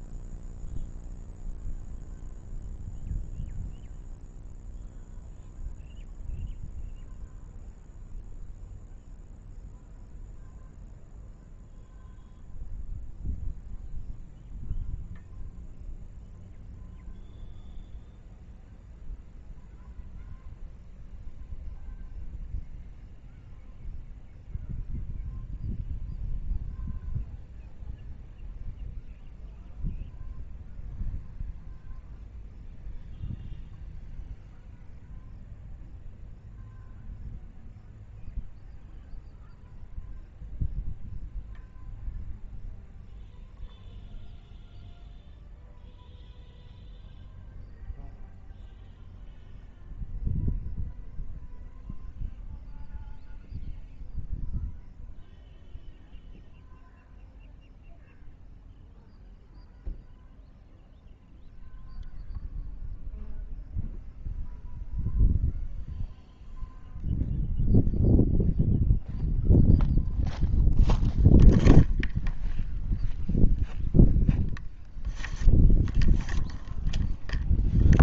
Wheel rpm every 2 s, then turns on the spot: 0, 0, 0, 0, 0, 0, 0, 0, 0, 0, 0, 0, 0, 0, 0, 0, 0, 0, 0, 0, 0, 0, 0, 0, 0, 0, 0, 0, 0, 0, 0, 0, 0, 0, 0, 0, 0, 0, 0.
none